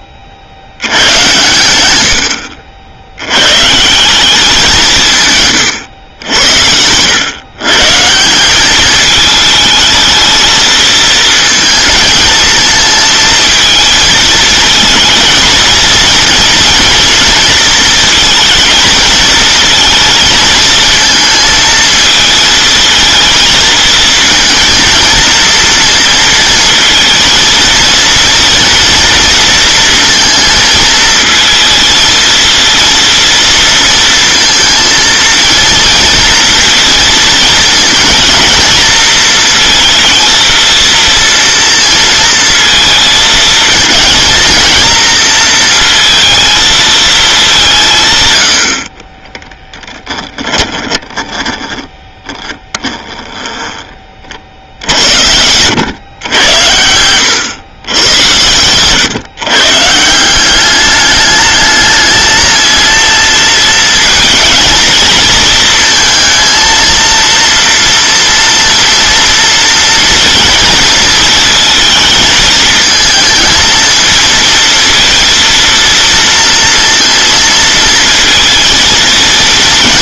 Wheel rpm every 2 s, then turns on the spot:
90, 70, 180, 90, 200, 220, 220, 220, 230, 220, 220, 230, 230, 230, 230, 230, 230, 230, 230, 230, 230, 220, 230, 220, 70, 10, 10, 60, 100, 100, 200, 220, 220, 230, 230, 230, 220, 230, 230, 230.
50-54 56-58